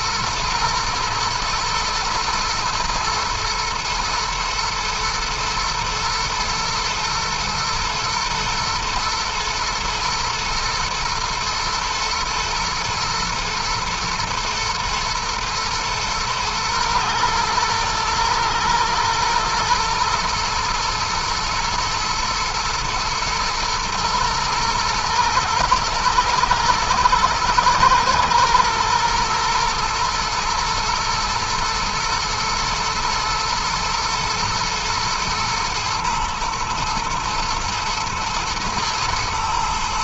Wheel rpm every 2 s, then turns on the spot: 120, 110, 110, 120, 110, 120, 120, 120, 110, 110, 120, 110, 120, 110, 120, 120, 110, 120, 110, 110.
none